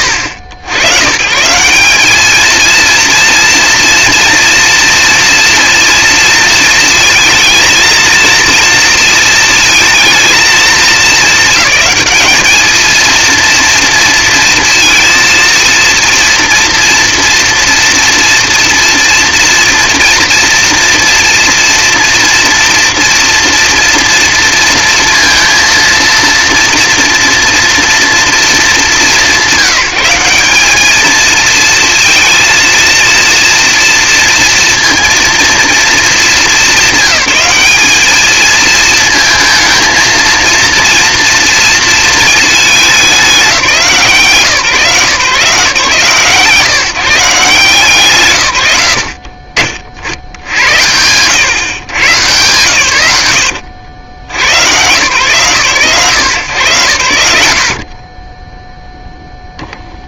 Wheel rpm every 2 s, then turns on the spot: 120, 230, 230, 230, 230, 220, 220, 230, 240, 230, 230, 230, 230, 240, 190, 210, 230, 230, 200, 230, 230, 220, 150, 160, 110, 70, 110, 110, 100, 0.
none